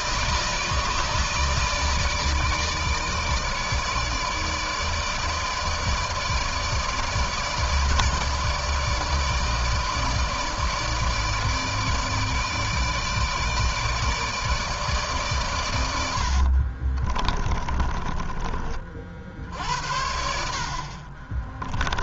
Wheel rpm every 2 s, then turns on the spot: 160, 160, 160, 150, 150, 150, 150, 150, 50, 40, 50.
16-18